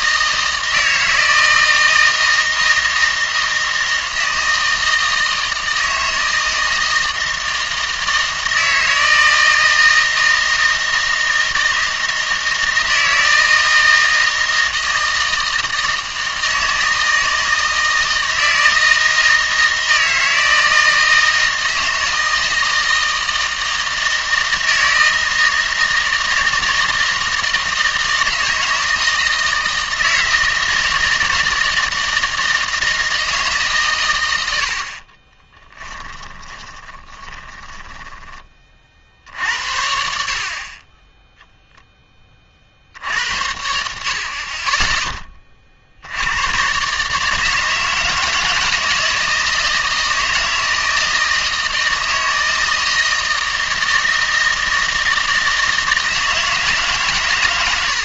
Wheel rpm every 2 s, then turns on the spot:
160, 160, 160, 160, 160, 160, 160, 160, 160, 160, 160, 160, 160, 160, 160, 160, 160, 80, 30, 40, 30, 60, 20, 120, 160, 160, 160, 160, 150.
36-38